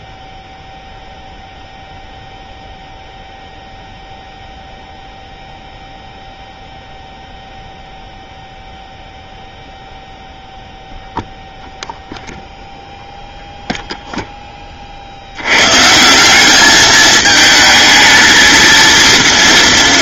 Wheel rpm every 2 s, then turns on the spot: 0, 0, 0, 0, 0, 0, 0, 40, 210, 230.
none